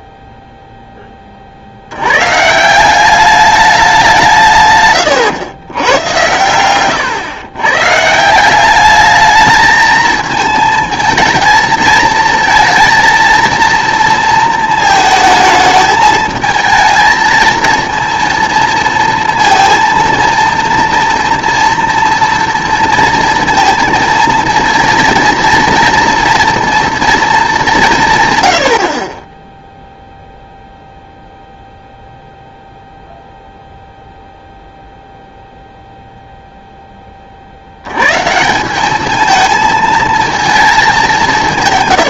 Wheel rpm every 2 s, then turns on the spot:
0, 160, 140, 110, 190, 230, 230, 230, 220, 230, 230, 230, 230, 230, 110, 0, 0, 0, 0, 180, 220.
none